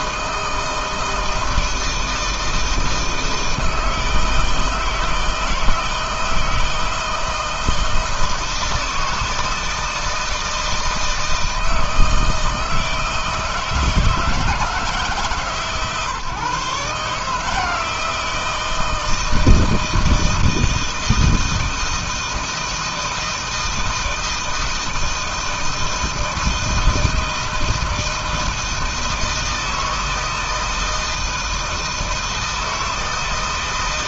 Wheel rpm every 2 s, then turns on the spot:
160, 160, 160, 160, 160, 160, 160, 140, 150, 160, 160, 160, 160, 160, 160, 160, 160.
none